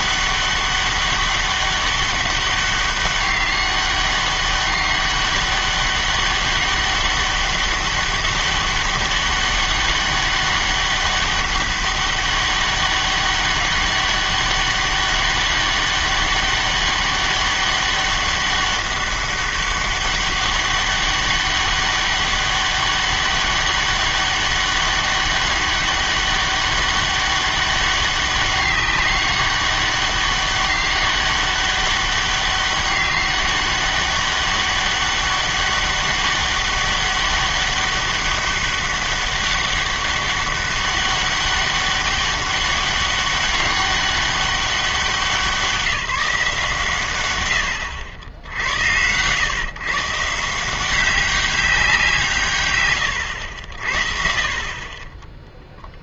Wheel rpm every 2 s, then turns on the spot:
200, 200, 200, 200, 200, 200, 200, 200, 200, 200, 200, 200, 200, 200, 200, 200, 190, 200, 200, 200, 200, 200, 200, 160, 80, 170, 110, 50.
none